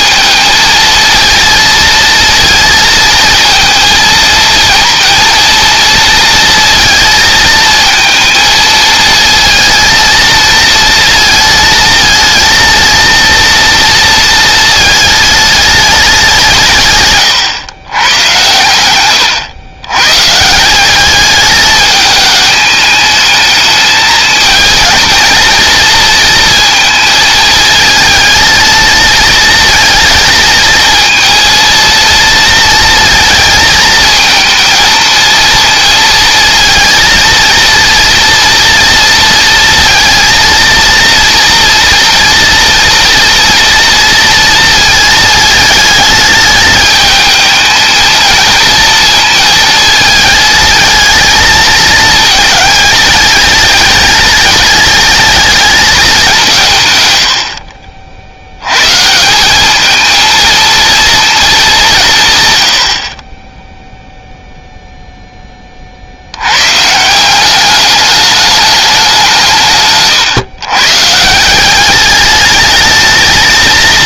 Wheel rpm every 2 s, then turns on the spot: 230, 230, 230, 230, 220, 230, 230, 220, 150, 110, 190, 210, 230, 220, 230, 230, 230, 220, 230, 230, 230, 240, 220, 220, 230, 220, 210, 210, 110, 130, 230, 60, 0, 160, 190, 140, 220.
none